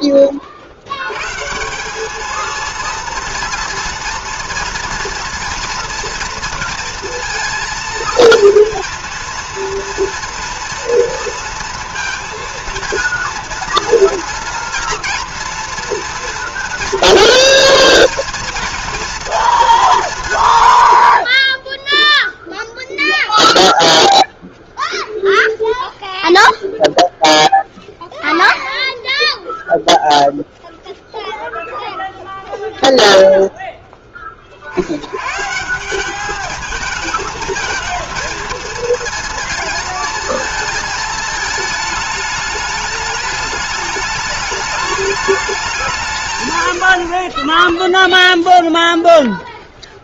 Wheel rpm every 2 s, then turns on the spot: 50, 220, 230, 230, 230, 230, 230, 230, 230, 230, 130, 0, 0, 0, 0, 0, 0, 50, 210, 230, 220, 210, 210, 100, 0.
none